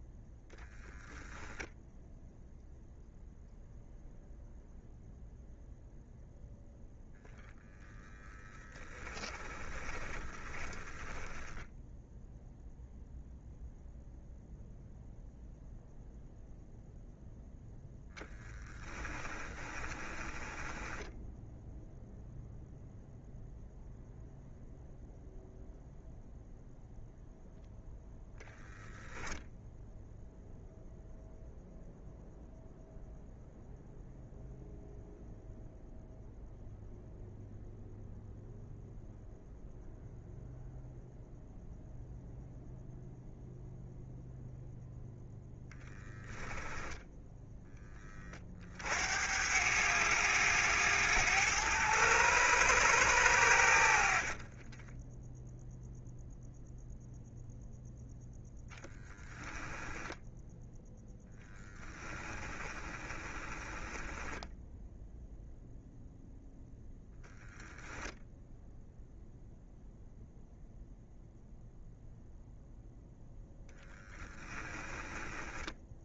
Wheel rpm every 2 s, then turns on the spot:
0, 0, 0, 0, 20, 20, 0, 0, 0, 10, 10, 0, 0, 0, 0, 0, 0, 0, 0, 0, 0, 0, 0, 10, 60, 100, 100, 10, 0, 10, 10, 20, 0, 0, 0, 0, 0, 10.
8-12 18-22 54-56 62-64 74-76